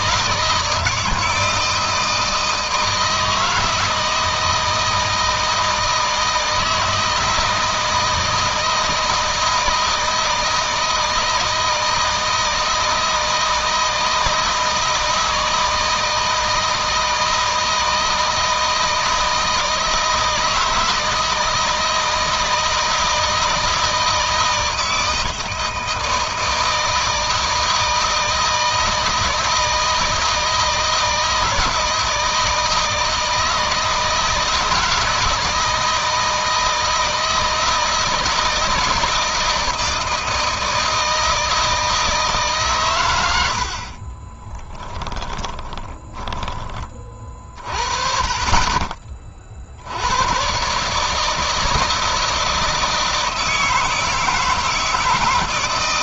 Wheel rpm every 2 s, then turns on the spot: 170, 160, 160, 160, 160, 160, 160, 160, 170, 160, 160, 160, 160, 160, 160, 160, 160, 160, 160, 160, 160, 120, 20, 30, 30, 150, 160, 160.
44-46